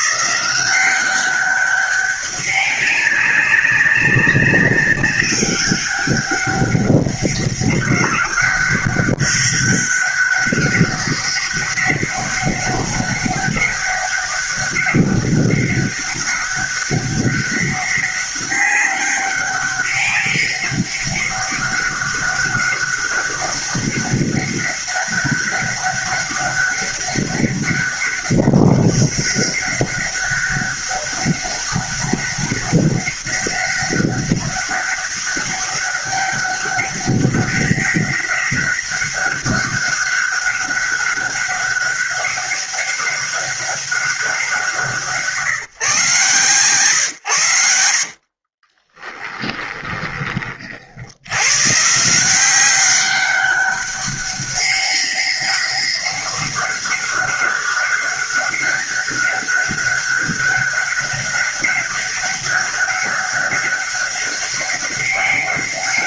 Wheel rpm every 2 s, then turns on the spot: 180, 200, 200, 200, 200, 200, 200, 200, 200, 200, 200, 200, 200, 200, 200, 200, 200, 200, 200, 200, 200, 200, 180, 130, 30, 40, 180, 190, 200, 200, 200, 200, 200.
48-50